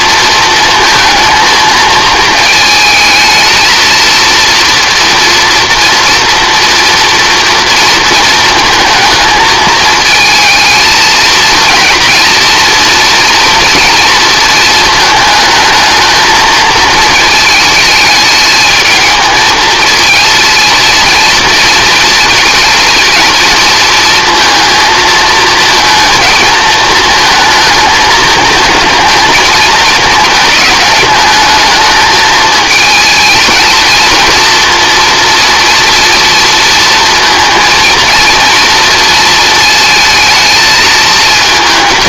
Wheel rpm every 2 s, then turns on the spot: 220, 220, 230, 230, 220, 220, 230, 220, 220, 210, 230, 230, 230, 230, 220, 210, 220, 230, 230, 230, 220.
none